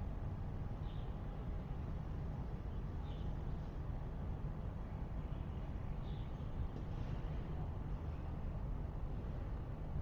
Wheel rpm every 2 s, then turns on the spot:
0, 0, 0, 0, 0.
none